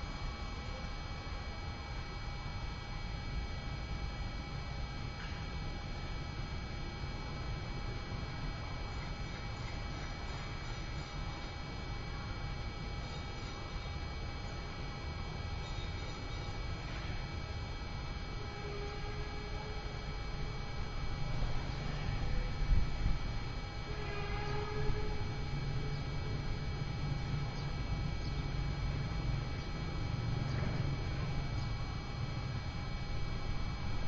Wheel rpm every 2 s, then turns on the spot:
0, 0, 0, 0, 0, 0, 0, 0, 0, 0, 0, 0, 0, 0, 0, 0, 0.
none